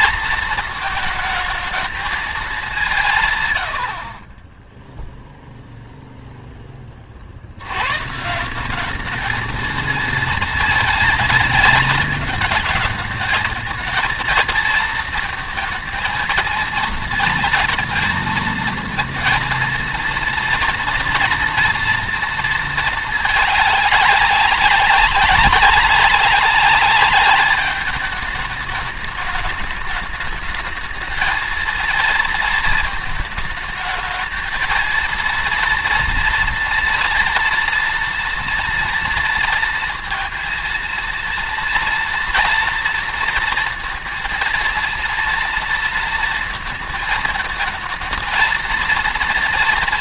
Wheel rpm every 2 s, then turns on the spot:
220, 200, 20, 10, 170, 220, 220, 230, 230, 230, 230, 220, 190, 200, 210, 220, 230, 230, 230, 230, 230, 230, 230, 220, 230.
none